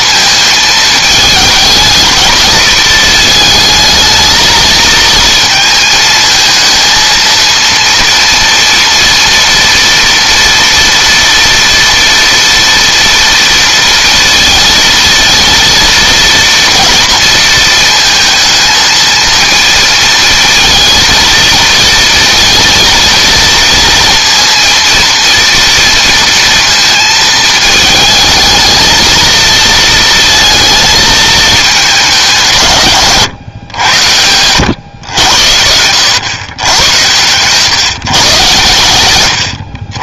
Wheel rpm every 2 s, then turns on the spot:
220, 230, 220, 230, 230, 230, 230, 230, 230, 230, 230, 230, 230, 230, 220, 220, 140, 100, 100, 110.
none